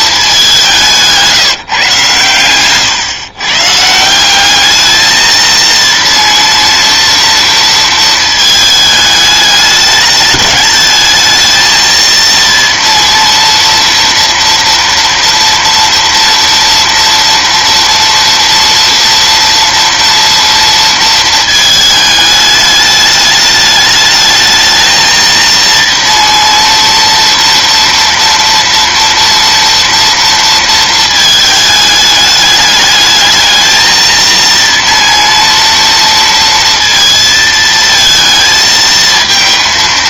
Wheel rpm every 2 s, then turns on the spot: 180, 120, 220, 230, 220, 220, 230, 230, 230, 230, 230, 210, 220, 230, 230, 220, 210, 230, 230, 220.
2-4